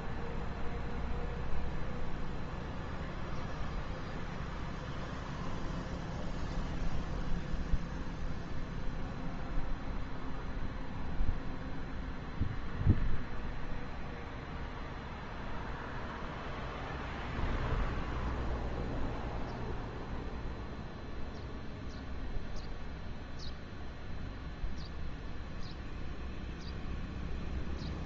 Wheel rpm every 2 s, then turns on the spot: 0, 0, 0, 0, 0, 0, 0, 0, 0, 0, 0, 0, 0, 0.
none